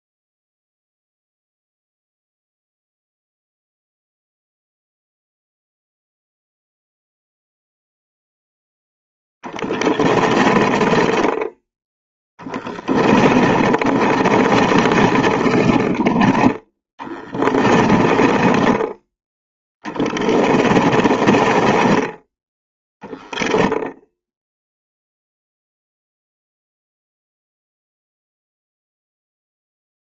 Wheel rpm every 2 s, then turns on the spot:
0, 0, 0, 0, 0, 20, 20, 30, 10, 20, 20, 10, 0, 0, 0.
10-22